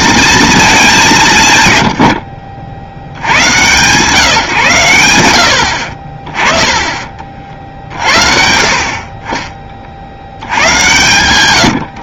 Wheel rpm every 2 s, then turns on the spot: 220, 70, 120, 30, 40, 110.
6-8